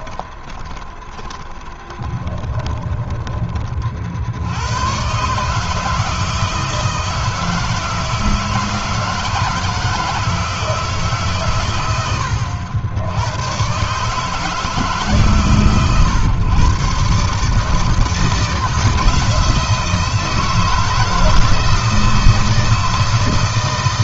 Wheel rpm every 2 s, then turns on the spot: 20, 20, 70, 160, 160, 160, 90, 150, 130, 130, 160, 160.
0-4